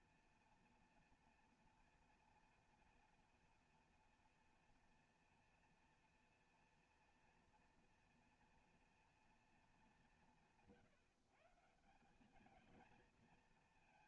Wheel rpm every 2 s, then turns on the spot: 230, 230, 240, 230, 240, 150, 230.
none